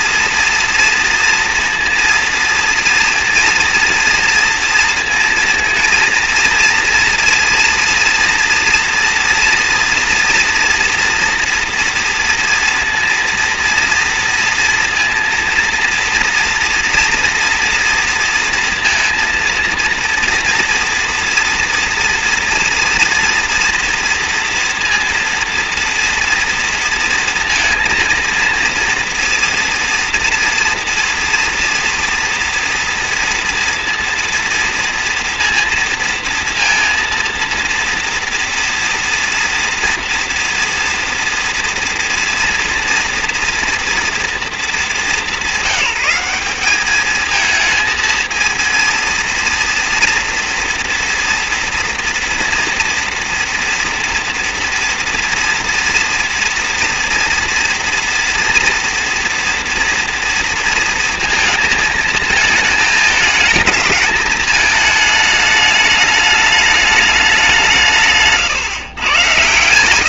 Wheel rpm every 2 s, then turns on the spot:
230, 230, 230, 230, 240, 230, 230, 230, 230, 230, 230, 230, 230, 230, 230, 240, 240, 230, 230, 230, 230, 230, 220, 210, 230, 230, 230, 230, 230, 240, 230, 220, 220, 210, 140.
none